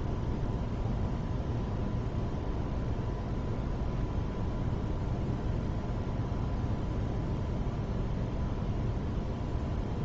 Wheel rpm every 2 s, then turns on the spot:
0, 0, 0, 0, 0.
none